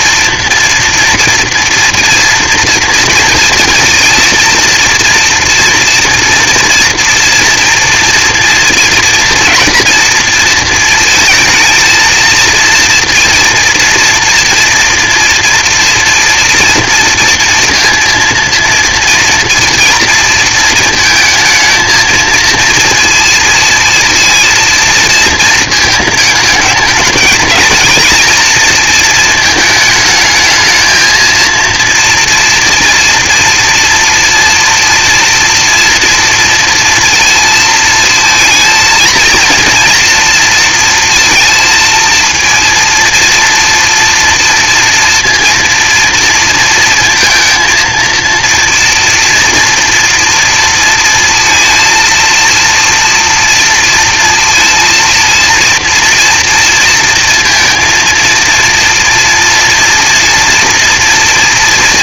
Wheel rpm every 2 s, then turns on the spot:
230, 230, 230, 230, 230, 230, 230, 230, 240, 230, 230, 230, 230, 210, 230, 220, 230, 240, 230, 230, 230, 230, 230, 230, 240, 230, 230, 230, 230, 230, 230.
none